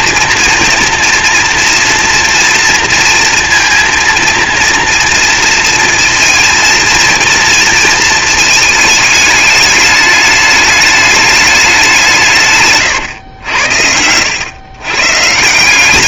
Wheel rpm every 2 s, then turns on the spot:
230, 230, 230, 230, 220, 210, 140, 120.
12-14